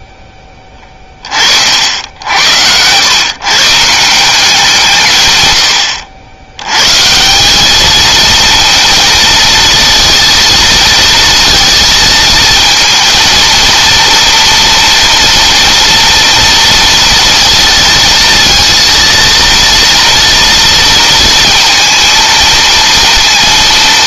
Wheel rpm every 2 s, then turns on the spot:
10, 80, 170, 100, 230, 230, 230, 240, 230, 230, 230, 230.
none